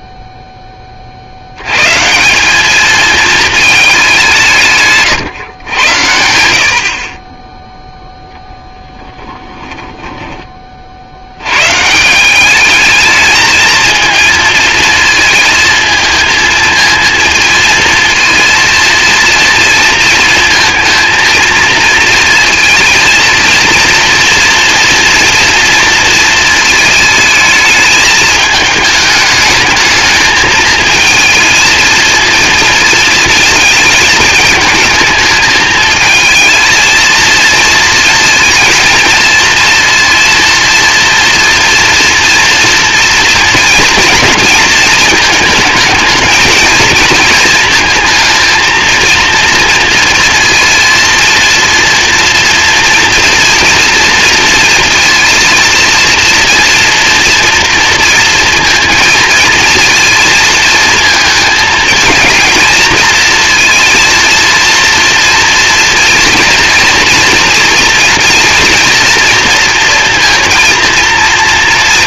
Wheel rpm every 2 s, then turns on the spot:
10, 190, 170, 80, 10, 50, 210, 220, 230, 230, 230, 230, 230, 220, 210, 220, 230, 220, 230, 230, 230, 230, 220, 220, 220, 230, 230, 230, 230, 230, 230, 230, 230, 230, 230, 230.
8-10